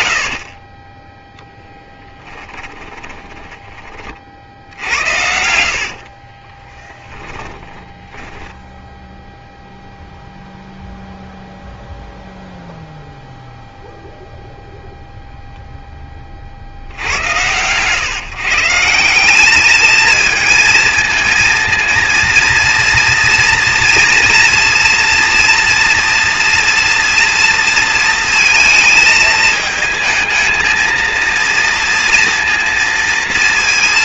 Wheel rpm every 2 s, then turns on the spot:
40, 20, 70, 10, 0, 0, 0, 0, 60, 160, 220, 230, 230, 240, 220, 220, 230.
0-8